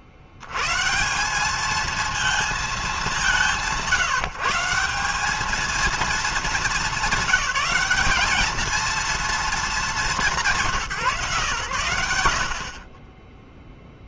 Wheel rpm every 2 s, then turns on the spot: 70, 220, 180, 220, 210, 170, 60.
none